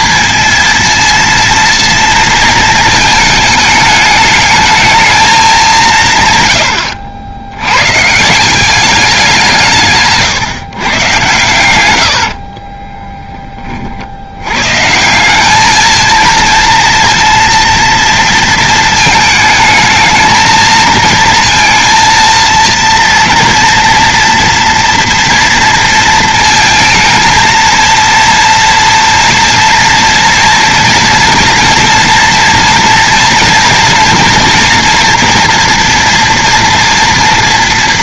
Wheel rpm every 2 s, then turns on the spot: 230, 230, 210, 130, 150, 140, 70, 80, 230, 230, 220, 230, 240, 230, 230, 230, 230, 230, 240.
12-14